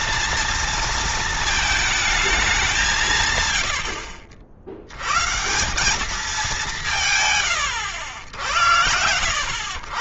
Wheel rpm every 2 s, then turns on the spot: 230, 170, 120, 170, 80.
none